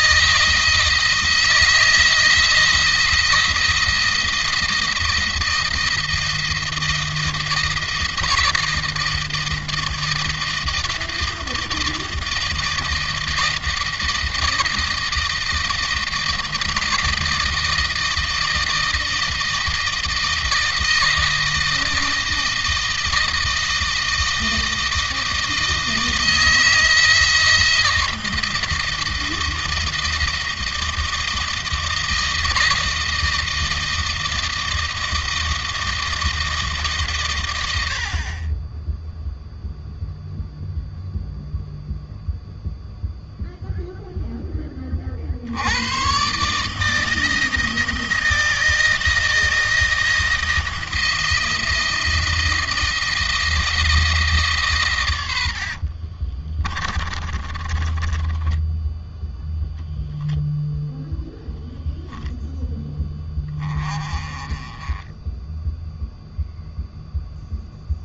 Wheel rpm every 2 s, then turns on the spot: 160, 170, 170, 170, 160, 160, 160, 160, 160, 160, 160, 160, 160, 160, 160, 160, 160, 160, 150, 20, 0, 0, 20, 150, 160, 160, 160, 130, 30, 10, 0, 10, 20, 0.
56-60